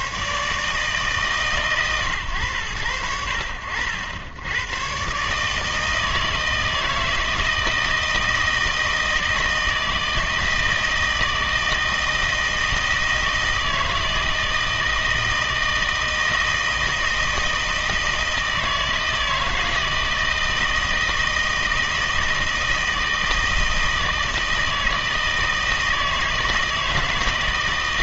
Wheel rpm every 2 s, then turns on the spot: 150, 110, 110, 160, 160, 160, 160, 160, 160, 160, 160, 160, 160, 160.
none